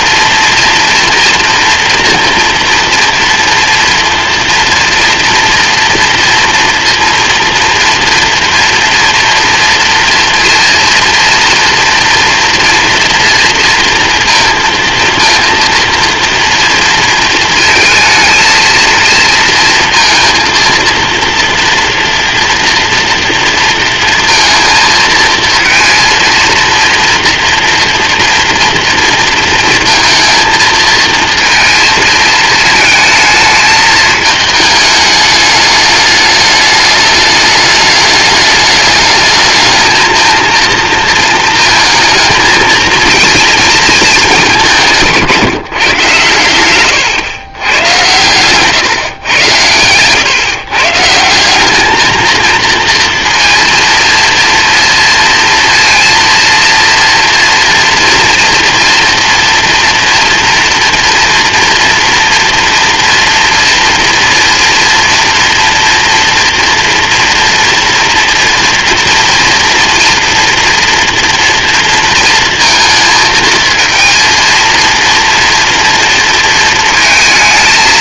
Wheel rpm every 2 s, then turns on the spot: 230, 230, 230, 230, 230, 230, 240, 230, 230, 230, 230, 230, 230, 240, 230, 220, 220, 210, 210, 210, 230, 230, 190, 110, 120, 140, 230, 230, 230, 230, 230, 230, 230, 240, 230, 230, 230, 230, 220.
none